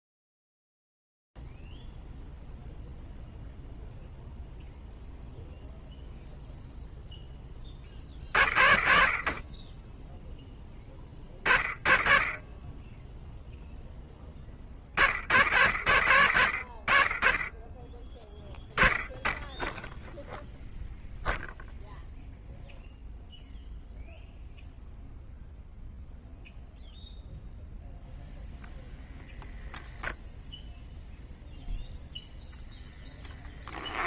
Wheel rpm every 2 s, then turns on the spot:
0, 0, 0, 0, 20, 20, 30, 10, 70, 10, 0, 0, 0, 0, 10, 0, 10.
32-34